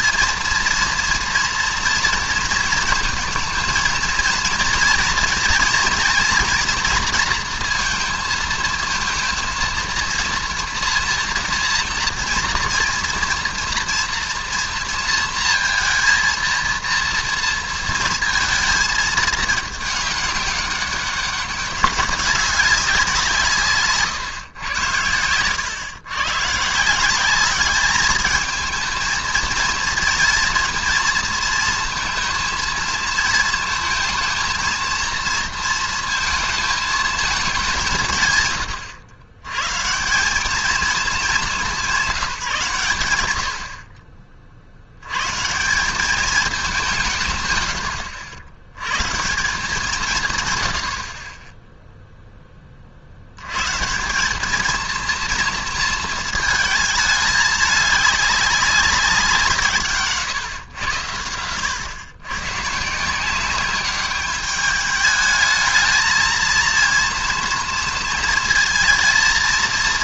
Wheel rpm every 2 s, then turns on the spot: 230, 230, 230, 240, 220, 230, 230, 240, 230, 220, 200, 190, 120, 140, 220, 230, 230, 230, 220, 120, 210, 160, 50, 200, 80, 120, 20, 210, 230, 200, 130, 130, 210, 230, 230.
none